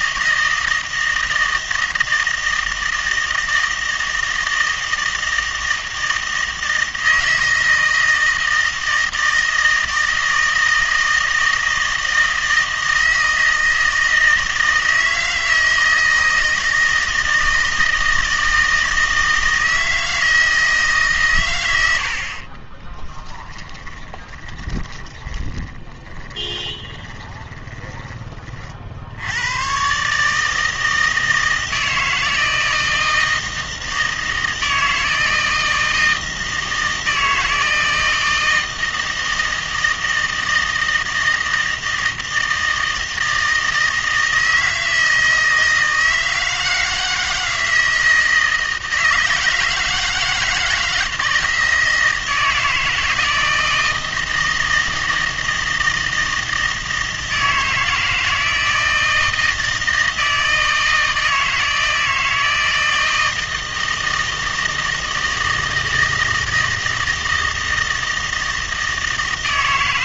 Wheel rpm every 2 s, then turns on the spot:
160, 160, 160, 160, 160, 160, 160, 160, 160, 160, 160, 30, 20, 20, 40, 160, 160, 160, 160, 160, 160, 160, 160, 160, 160, 160, 160, 160, 160, 160, 160, 160, 160, 160, 160.
22-28